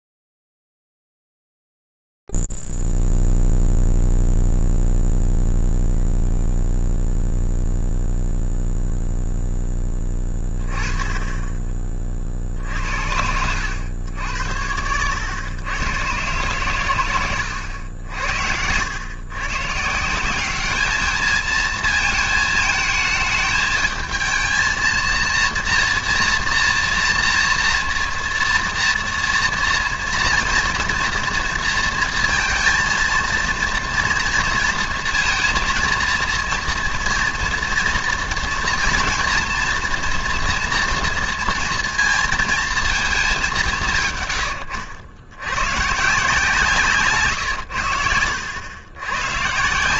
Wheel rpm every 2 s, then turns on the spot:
0, 0, 0, 0, 0, 10, 40, 90, 110, 80, 170, 230, 220, 230, 230, 230, 230, 230, 230, 240, 240, 230, 120, 160, 80.
none